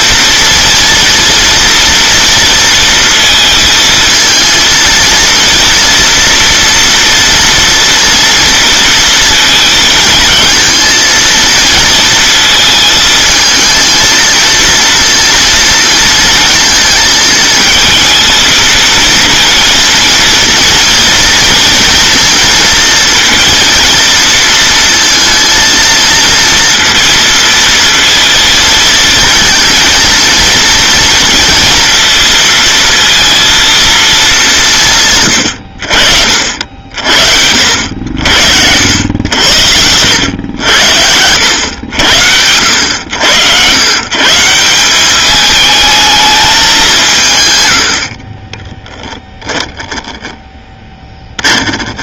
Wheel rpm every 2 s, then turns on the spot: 230, 230, 230, 230, 230, 230, 220, 230, 220, 220, 230, 230, 230, 230, 230, 230, 230, 150, 60, 90, 80, 90, 190, 180, 10, 10.
48-50